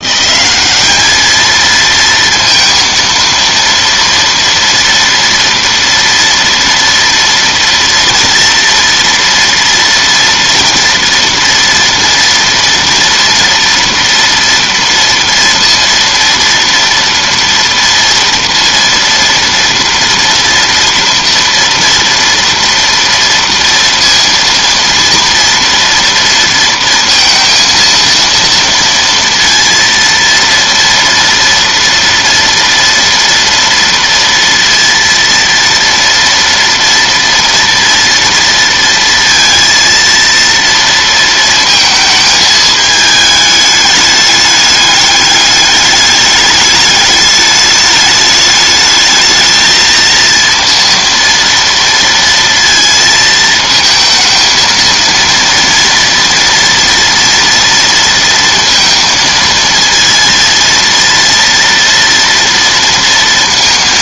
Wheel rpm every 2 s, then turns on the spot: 200, 230, 230, 230, 230, 230, 230, 230, 230, 230, 230, 230, 230, 230, 230, 240, 230, 230, 230, 230, 230, 210, 210, 210, 210, 230, 230, 230, 230, 230, 230, 230.
none